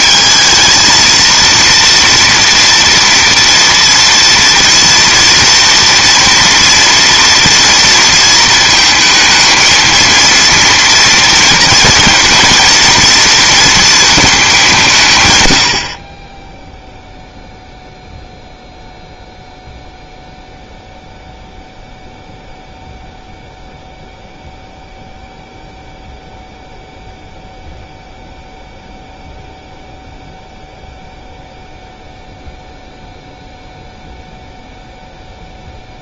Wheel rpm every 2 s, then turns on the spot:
220, 230, 230, 230, 220, 230, 230, 170, 0, 0, 0, 0, 0, 0, 0, 0, 0, 0.
none